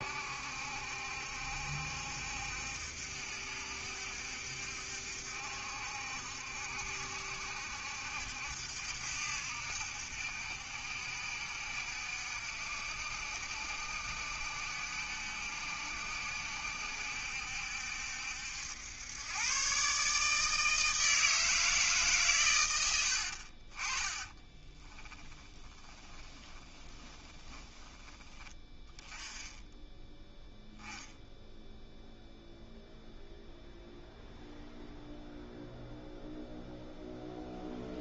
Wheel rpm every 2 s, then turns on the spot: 70, 70, 70, 70, 70, 70, 70, 70, 70, 90, 160, 100, 20, 20, 10, 0, 0, 0, 0.
24-28